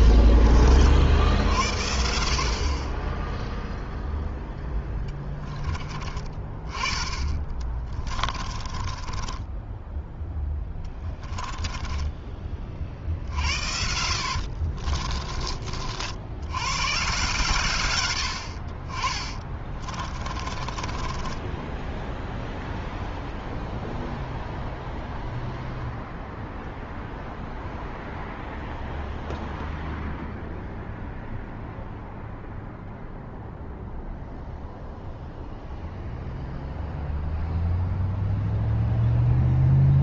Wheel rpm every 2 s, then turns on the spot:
70, 10, 10, 20, 20, 10, 70, 30, 140, 20, 10, 0, 0, 0, 0, 0, 0, 0, 0, 0.
6-12 14-16 18-22